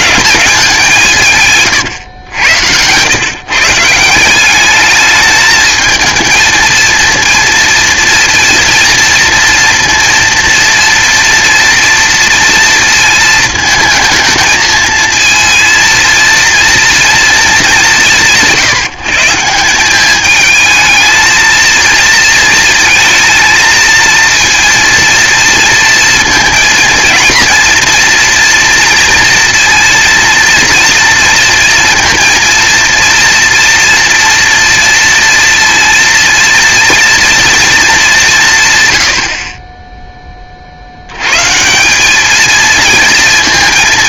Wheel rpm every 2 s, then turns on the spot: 190, 100, 200, 230, 230, 230, 230, 220, 230, 160, 220, 230, 230, 230, 230, 230, 230, 240, 230, 120, 50, 220.
none